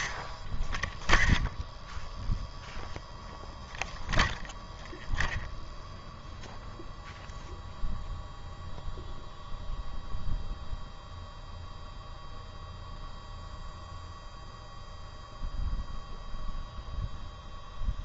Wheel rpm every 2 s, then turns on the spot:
0, 0, 0, 0, 0, 0, 0, 0, 0.
none